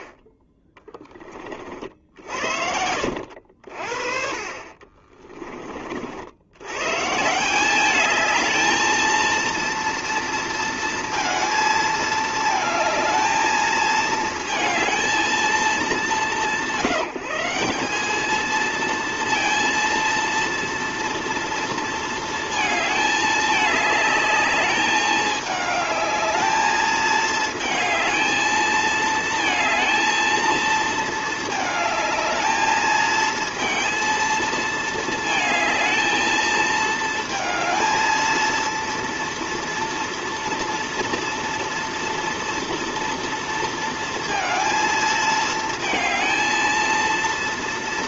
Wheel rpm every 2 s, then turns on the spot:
30, 60, 40, 80, 210, 230, 220, 220, 170, 210, 230, 220, 210, 210, 220, 220, 220, 230, 220, 230, 230, 230, 230, 220.
2-4